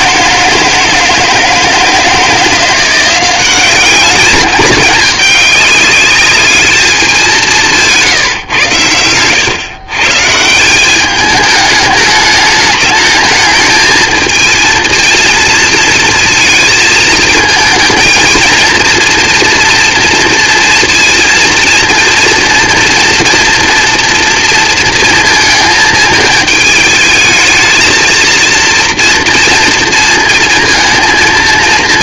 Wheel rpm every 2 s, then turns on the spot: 160, 170, 210, 210, 140, 150, 210, 220, 220, 230, 230, 230, 230, 220, 230, 230.
none